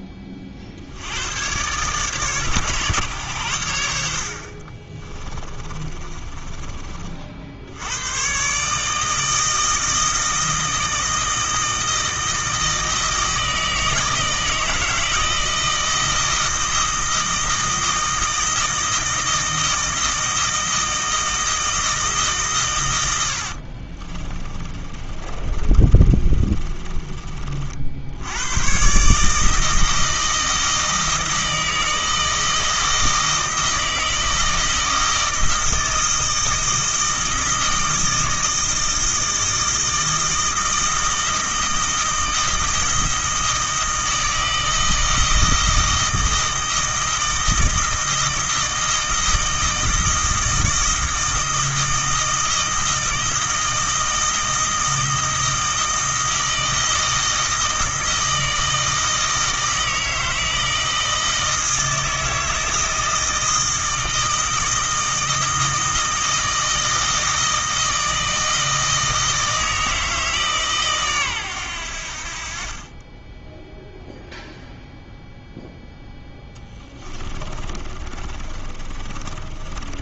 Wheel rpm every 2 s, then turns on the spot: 50, 130, 40, 30, 150, 160, 160, 160, 160, 160, 160, 120, 30, 30, 110, 160, 160, 160, 160, 160, 160, 160, 160, 160, 160, 160, 160, 160, 160, 160, 160, 160, 160, 160, 160, 150, 40, 0, 10, 30.
4-6 24-28 76-80